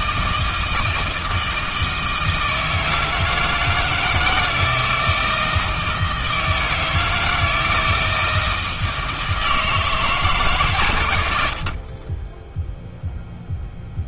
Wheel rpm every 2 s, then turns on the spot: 160, 160, 160, 160, 160, 120, 0.
none